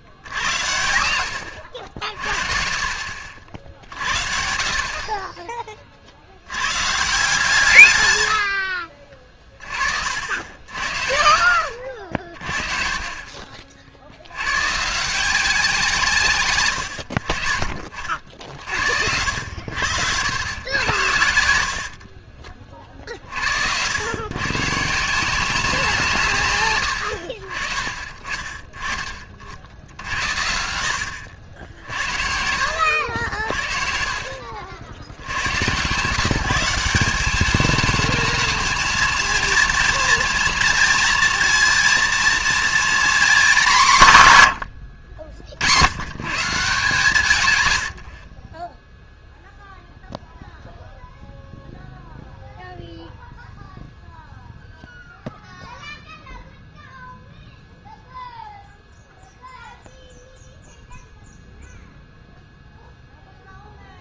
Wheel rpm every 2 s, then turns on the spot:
80, 40, 50, 110, 60, 70, 40, 120, 110, 60, 90, 40, 130, 120, 20, 80, 70, 70, 180, 220, 230, 230, 110, 160, 20, 0, 0, 0, 0, 0, 0, 0.
8-10 22-24 30-32